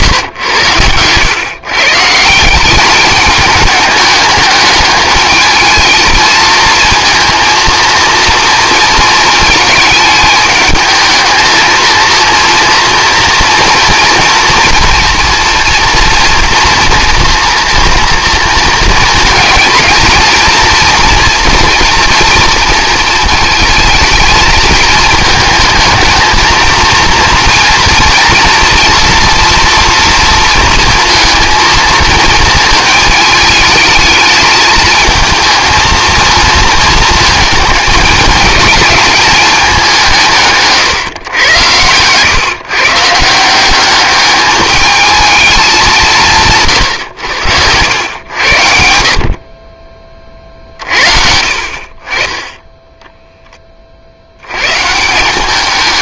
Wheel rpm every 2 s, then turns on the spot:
100, 190, 210, 230, 230, 220, 230, 240, 240, 230, 230, 230, 220, 230, 230, 230, 220, 220, 220, 210, 140, 140, 210, 130, 70, 50, 10, 130.
40-42